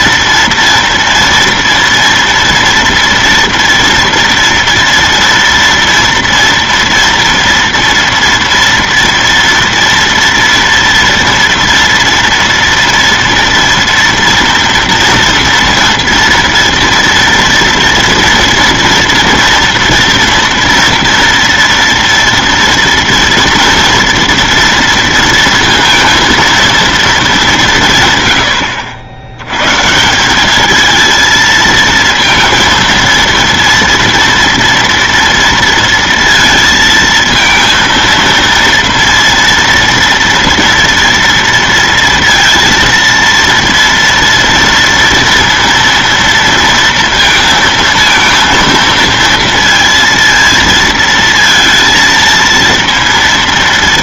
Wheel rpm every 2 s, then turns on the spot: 240, 230, 240, 230, 230, 230, 230, 230, 230, 230, 230, 230, 230, 230, 110, 210, 230, 230, 230, 230, 230, 230, 230, 230, 230, 230, 230.
28-30